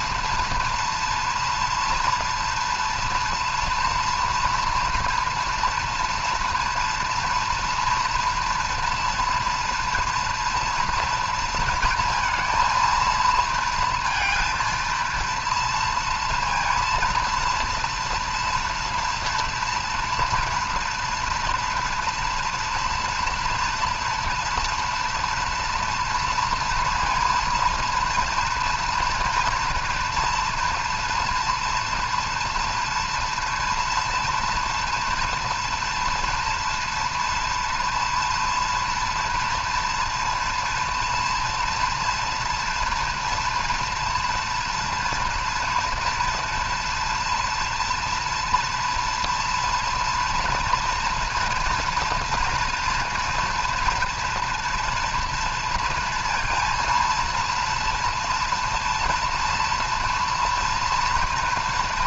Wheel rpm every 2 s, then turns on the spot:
240, 230, 230, 230, 230, 240, 230, 230, 230, 240, 240, 230, 230, 230, 230, 230, 230, 230, 240, 240, 230, 230, 230, 230, 240, 230, 230, 230, 230, 230, 230.
none